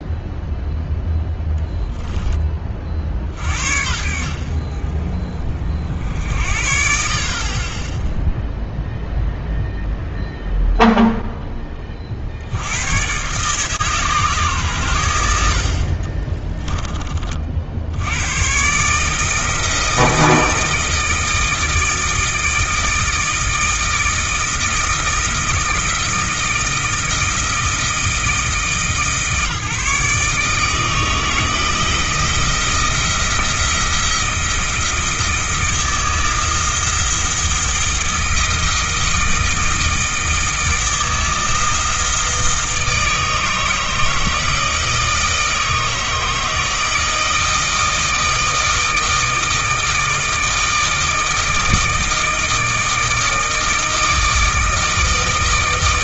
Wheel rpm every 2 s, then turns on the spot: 0, 40, 30, 50, 0, 0, 100, 110, 20, 150, 160, 160, 160, 160, 150, 160, 170, 170, 160, 160, 160, 160, 160, 160, 160, 160, 160, 160.
16-18